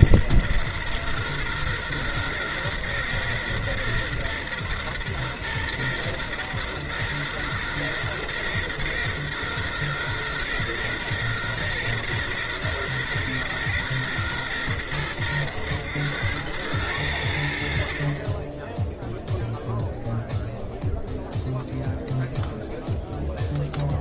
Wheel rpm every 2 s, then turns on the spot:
120, 120, 120, 120, 120, 120, 120, 120, 100, 10, 0, 0.
none